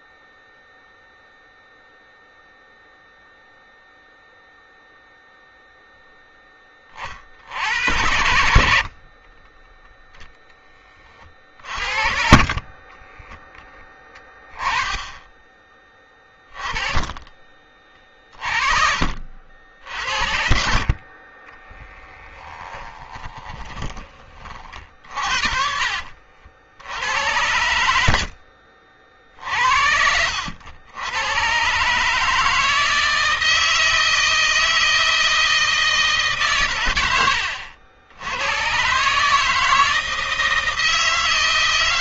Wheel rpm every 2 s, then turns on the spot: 0, 0, 0, 30, 50, 30, 20, 20, 20, 40, 50, 20, 40, 80, 50, 90, 160, 160, 100, 130, 160.
12-18 22-24